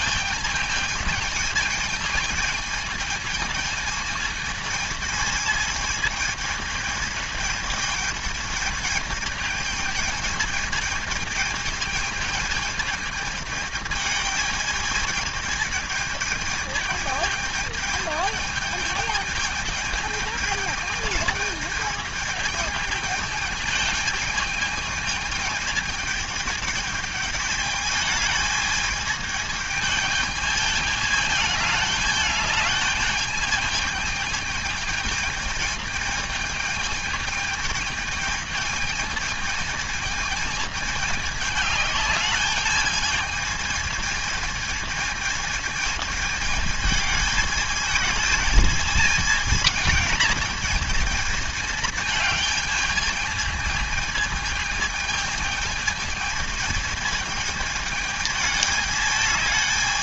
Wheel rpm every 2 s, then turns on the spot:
220, 220, 220, 220, 210, 220, 220, 210, 220, 210, 220, 220, 210, 210, 220, 210, 210, 220, 220, 220, 220, 210, 220, 210, 220, 220, 220, 220, 220, 210.
none